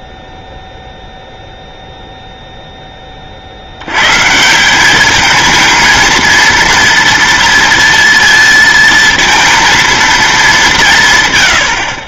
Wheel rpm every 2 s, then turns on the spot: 0, 10, 190, 230, 220, 210.
none